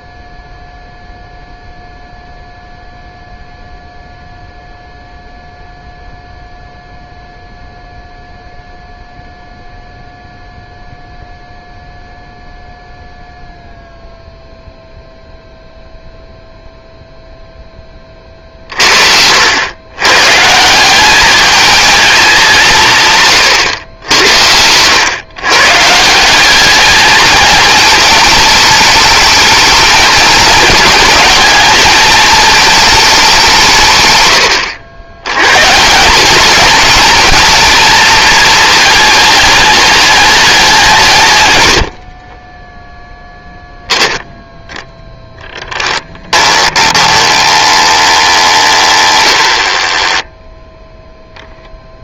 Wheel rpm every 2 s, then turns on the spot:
0, 0, 0, 0, 0, 0, 0, 0, 0, 50, 170, 160, 100, 210, 210, 210, 220, 90, 210, 230, 190, 10, 10, 10, 10, 0.
18-20 42-44 46-48